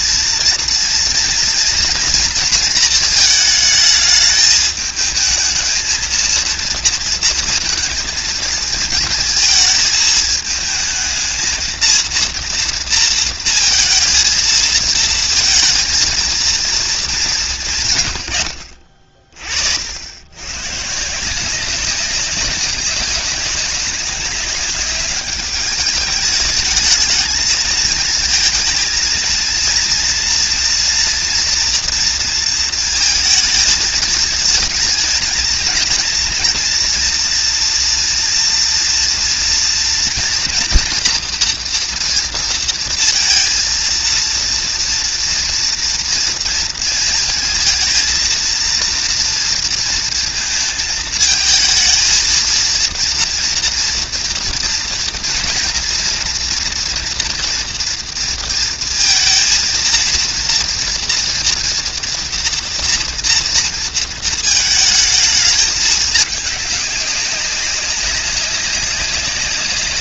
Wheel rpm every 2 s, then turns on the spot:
230, 230, 210, 230, 230, 220, 230, 230, 230, 80, 120, 190, 200, 210, 220, 230, 230, 220, 230, 230, 230, 230, 230, 230, 230, 230, 230, 230, 230, 230, 240, 230, 220, 200, 200.
none